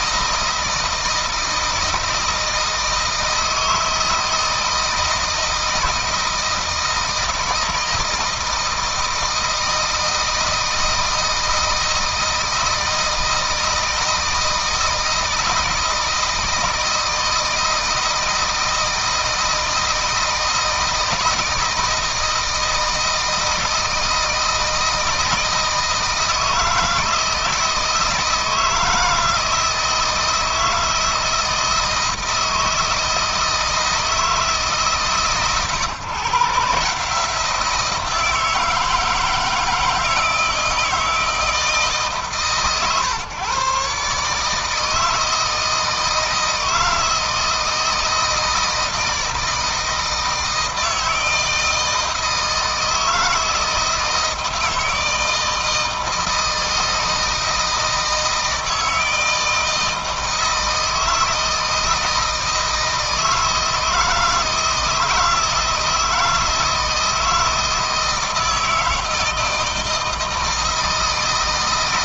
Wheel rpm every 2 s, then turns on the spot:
160, 160, 160, 160, 160, 160, 160, 160, 160, 160, 160, 160, 160, 160, 160, 160, 160, 150, 150, 160, 160, 140, 160, 160, 170, 160, 160, 160, 160, 160, 160, 160, 160, 160, 160, 160.
none